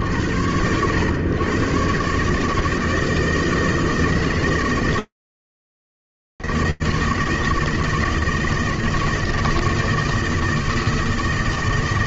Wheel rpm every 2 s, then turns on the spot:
50, 150, 160, 160, 160, 160.
none